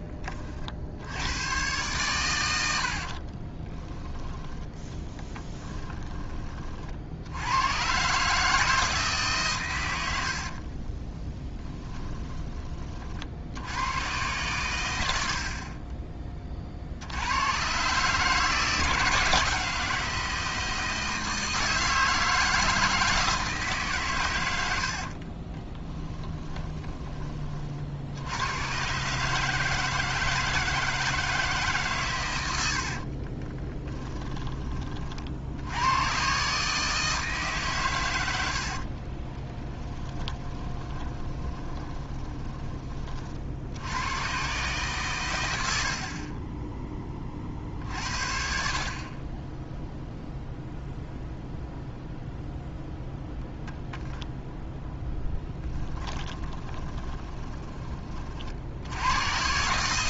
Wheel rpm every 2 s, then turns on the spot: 30, 80, 10, 40, 160, 30, 30, 110, 50, 160, 160, 160, 80, 30, 120, 160, 70, 30, 150, 60, 20, 20, 140, 10, 70, 0, 0, 10, 20, 70.
2-4 10-12 24-28 32-34 38-42 56-58